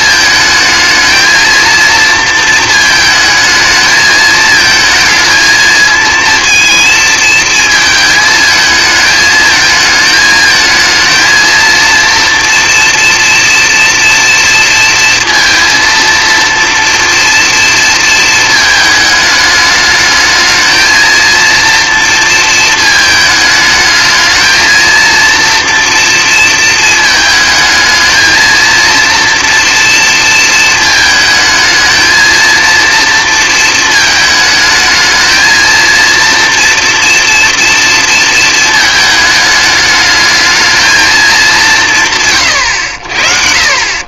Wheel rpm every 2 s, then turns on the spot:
220, 220, 220, 230, 220, 220, 240, 230, 230, 220, 220, 220, 220, 230, 230, 230, 230, 220, 230, 230, 220, 120.
none